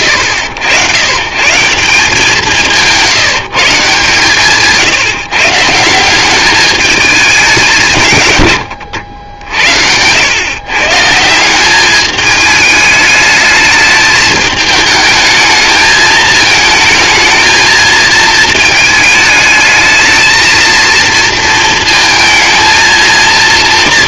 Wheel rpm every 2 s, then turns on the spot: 100, 180, 160, 210, 90, 130, 210, 220, 220, 220, 220, 230.
none